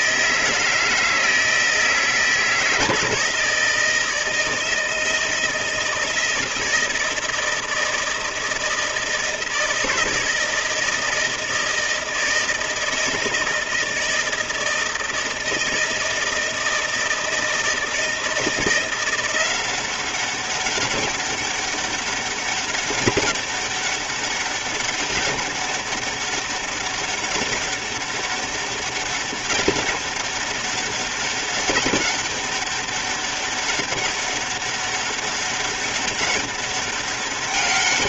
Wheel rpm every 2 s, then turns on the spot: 160, 160, 160, 160, 160, 160, 160, 160, 160, 170, 190, 200, 200, 200, 200, 200, 200, 200, 200.
none